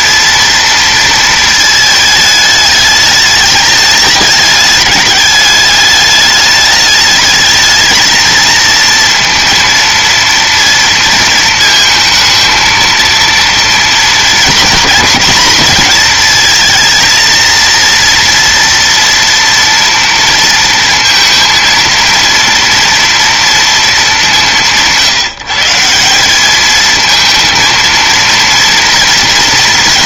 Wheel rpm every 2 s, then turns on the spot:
230, 210, 210, 210, 230, 230, 220, 230, 220, 230, 230, 230, 180, 210, 230.
none